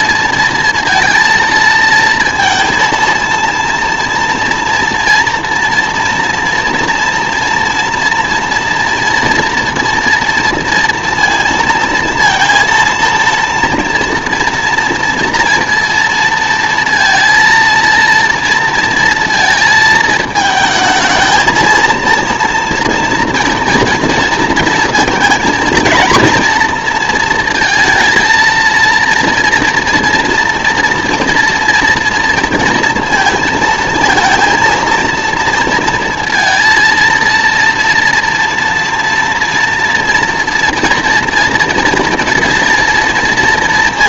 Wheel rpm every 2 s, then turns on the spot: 230, 230, 230, 240, 240, 240, 230, 230, 230, 230, 220, 230, 230, 230, 230, 230, 230, 230, 230, 240, 230, 230.
none